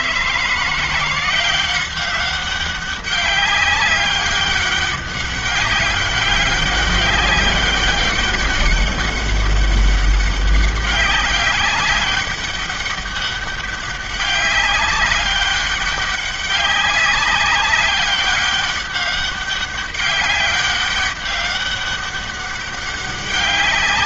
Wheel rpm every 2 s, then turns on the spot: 170, 190, 200, 200, 200, 200, 200, 200, 200, 200, 200, 200.
none